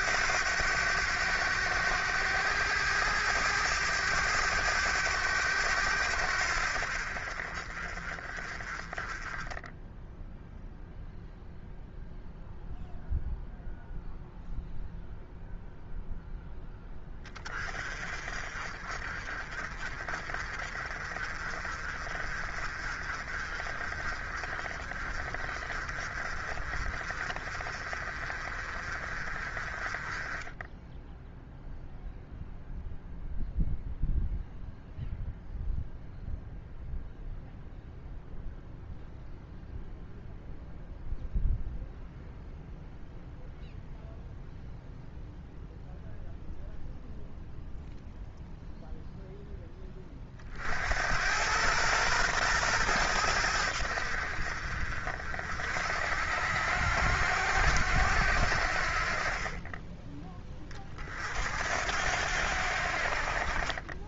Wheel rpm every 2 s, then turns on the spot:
100, 100, 100, 60, 20, 0, 0, 0, 10, 40, 40, 40, 40, 40, 40, 10, 0, 0, 0, 0, 0, 0, 0, 0, 0, 50, 110, 50, 80, 60, 30, 70.
none